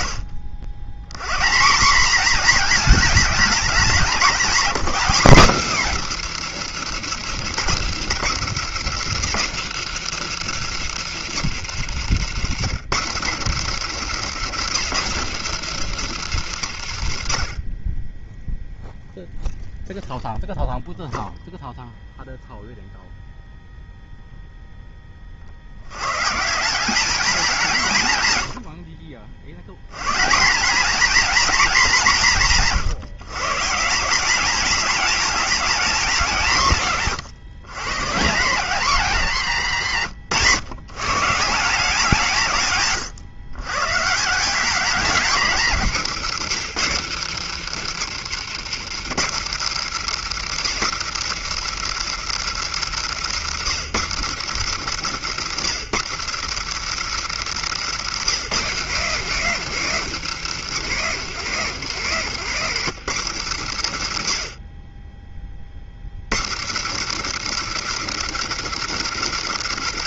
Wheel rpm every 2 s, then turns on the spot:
80, 230, 240, 180, 170, 160, 160, 180, 80, 0, 0, 0, 80, 170, 80, 220, 160, 210, 120, 130, 180, 130, 190, 160, 160, 170, 160, 160, 170, 210, 190, 150, 20, 160, 180.
56-58